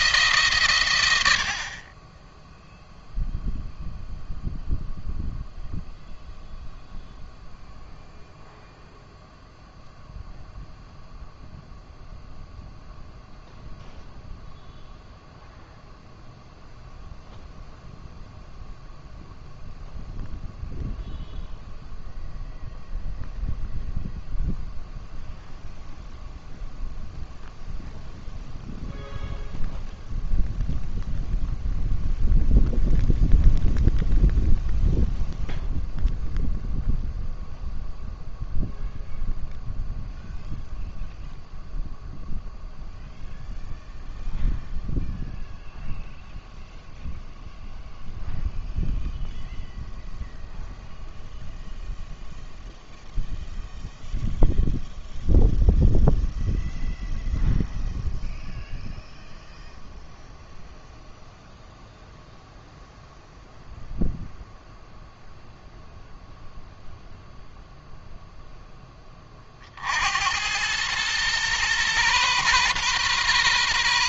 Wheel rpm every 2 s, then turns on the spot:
130, 0, 0, 0, 0, 0, 0, 0, 0, 0, 0, 0, 0, 0, 0, 0, 0, 0, 0, 0, 0, 0, 0, 0, 0, 0, 0, 0, 0, 0, 0, 0, 0, 0, 10, 100, 120.
none